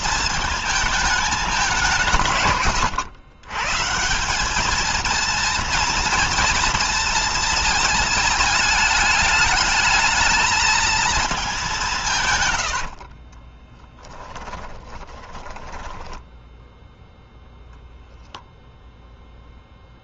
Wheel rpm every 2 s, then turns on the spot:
220, 140, 190, 230, 220, 220, 150, 20, 10, 0.
12-16